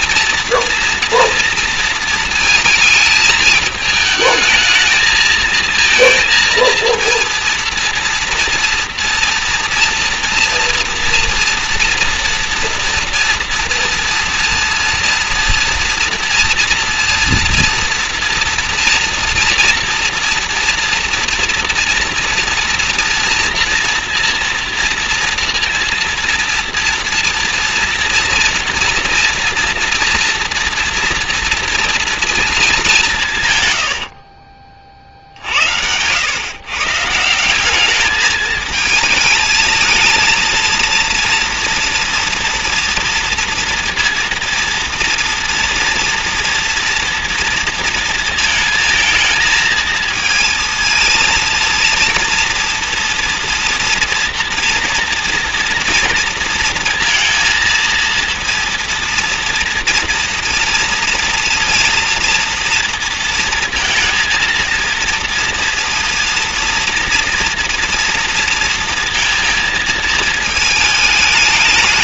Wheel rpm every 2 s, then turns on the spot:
230, 220, 220, 230, 240, 240, 230, 230, 230, 230, 230, 230, 230, 240, 240, 230, 220, 50, 120, 210, 230, 230, 230, 230, 220, 230, 230, 230, 230, 230, 240, 230, 230, 230, 230, 220.
34-36